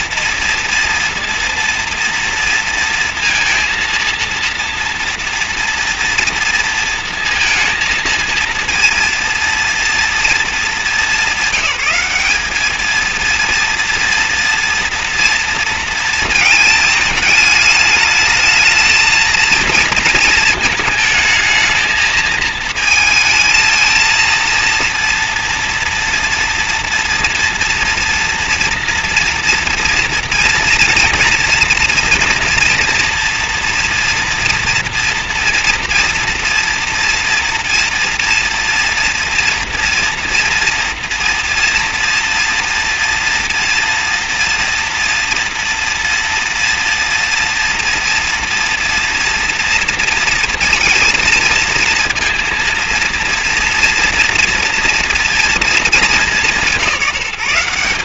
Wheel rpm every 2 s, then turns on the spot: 230, 230, 230, 230, 230, 220, 210, 240, 220, 220, 220, 220, 230, 230, 230, 230, 230, 240, 230, 230, 240, 230, 240, 230, 230, 230, 230, 230, 190.
none